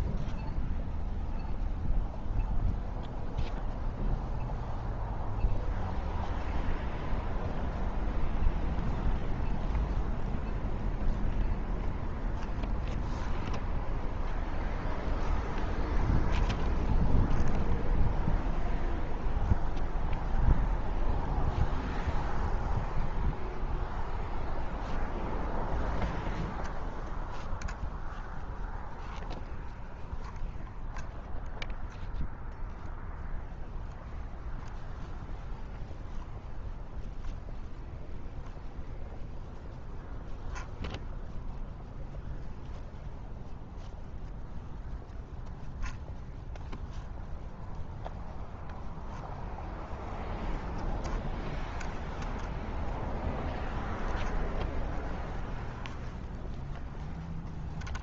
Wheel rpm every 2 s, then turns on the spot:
0, 0, 0, 0, 0, 0, 0, 0, 0, 0, 0, 0, 0, 0, 0, 0, 0, 0, 0, 0, 0, 0, 0, 0, 0, 0, 0, 0, 0.
none